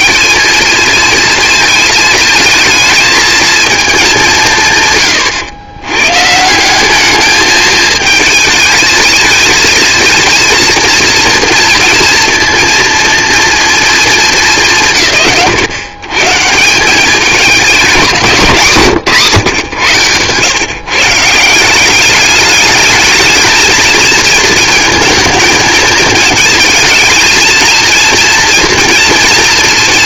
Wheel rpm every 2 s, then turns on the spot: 230, 220, 130, 200, 220, 230, 230, 100, 190, 160, 150, 210, 230, 230, 230.
none